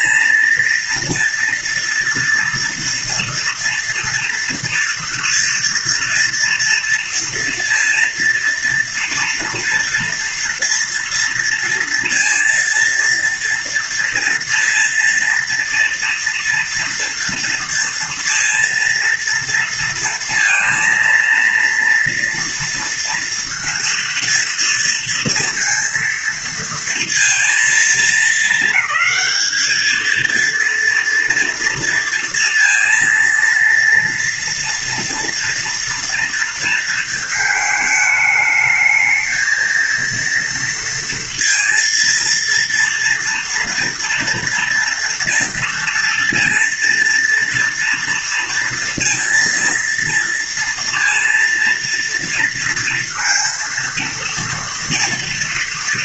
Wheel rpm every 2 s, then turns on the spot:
230, 240, 230, 230, 230, 230, 230, 230, 230, 230, 230, 230, 230, 230, 220, 230, 230, 230, 220, 220, 230, 230, 230, 230, 230, 230, 230, 230.
none